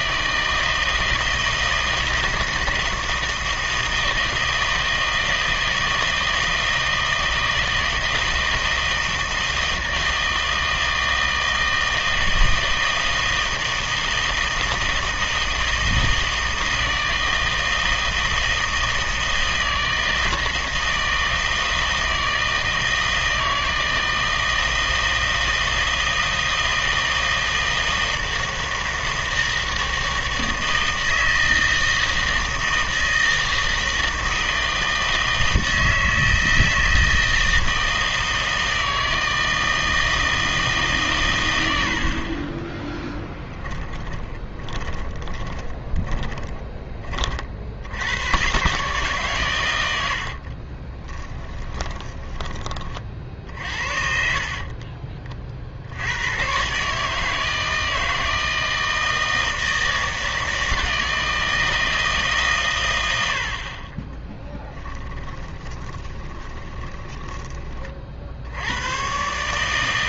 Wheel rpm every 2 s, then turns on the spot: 160, 160, 160, 160, 160, 160, 160, 160, 160, 160, 160, 160, 160, 160, 160, 160, 160, 160, 160, 160, 160, 20, 20, 20, 130, 30, 20, 40, 130, 160, 160, 140, 10, 20, 90.
44-48 50-52 54-56 64-68